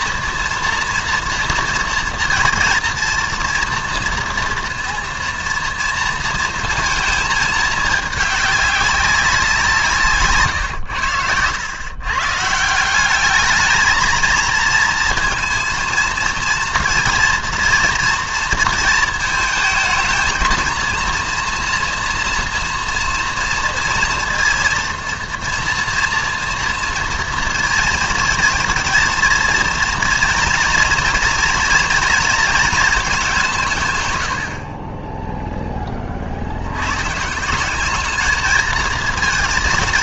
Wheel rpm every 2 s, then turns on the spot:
230, 230, 230, 230, 200, 120, 160, 230, 230, 230, 230, 230, 230, 230, 220, 240, 220, 50, 90, 220.
none